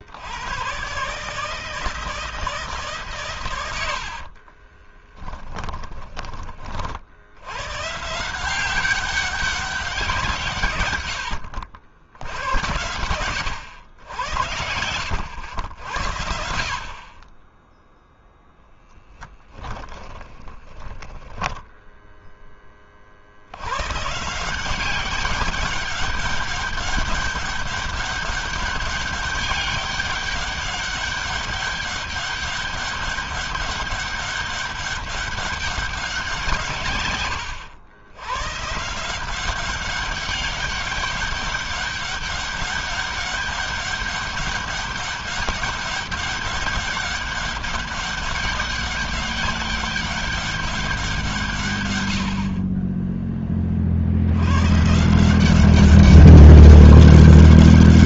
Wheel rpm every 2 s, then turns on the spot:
130, 140, 20, 60, 190, 110, 100, 80, 40, 10, 10, 40, 190, 200, 200, 200, 200, 200, 130, 160, 200, 200, 200, 200, 190, 180, 20, 150, 190.
4-6 18-22